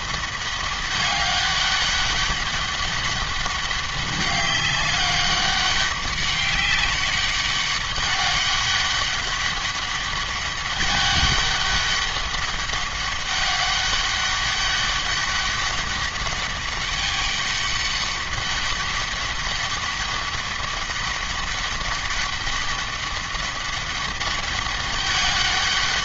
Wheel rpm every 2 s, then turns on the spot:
200, 200, 190, 200, 200, 200, 200, 200, 200, 200, 200, 200, 200.
none